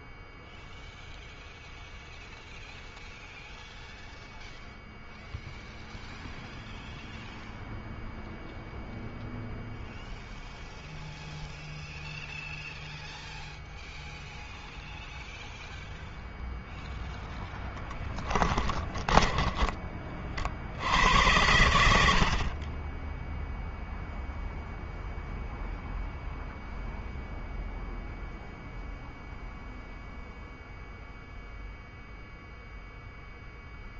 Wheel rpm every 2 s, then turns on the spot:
0, 0, 0, 0, 0, 0, 0, 0, 0, 20, 80, 20, 0, 0, 0, 0, 0.
18-20